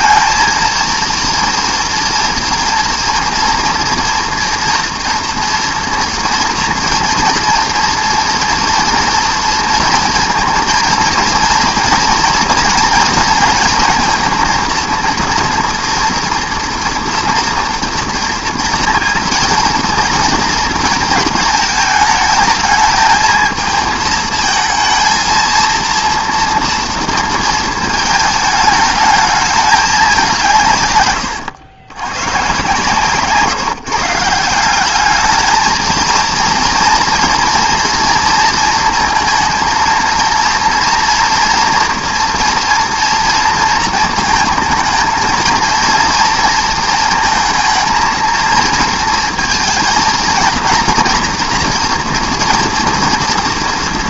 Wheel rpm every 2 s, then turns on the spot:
230, 240, 230, 230, 230, 230, 230, 230, 240, 240, 230, 220, 220, 230, 220, 150, 130, 180, 240, 230, 230, 230, 220, 230, 230, 230, 230.
none